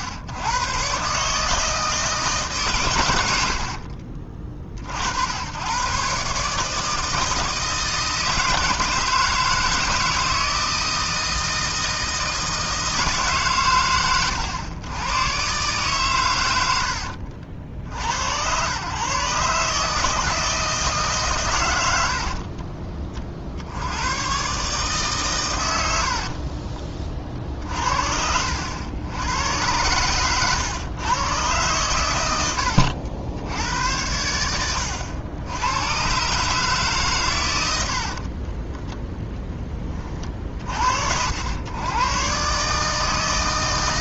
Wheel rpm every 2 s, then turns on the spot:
130, 140, 60, 150, 160, 160, 160, 110, 80, 120, 150, 30, 140, 40, 90, 110, 80, 100, 150, 0, 50, 150.
none